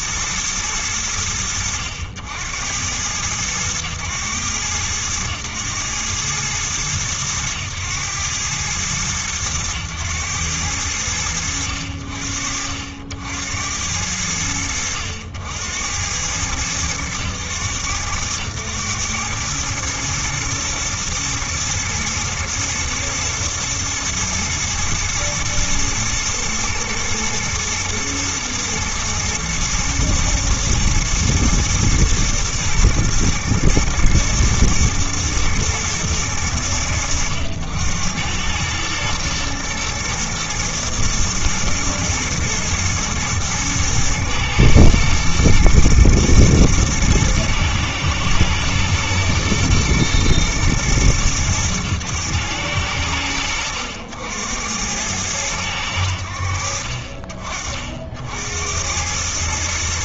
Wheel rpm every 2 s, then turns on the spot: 100, 90, 100, 110, 110, 90, 70, 80, 100, 100, 110, 110, 120, 110, 110, 110, 120, 120, 90, 110, 110, 110, 120, 120, 120, 110, 100, 90, 50, 90.
none